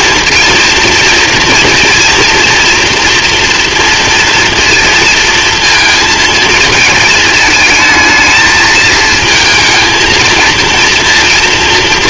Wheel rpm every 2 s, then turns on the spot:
230, 240, 230, 220, 220, 230.
none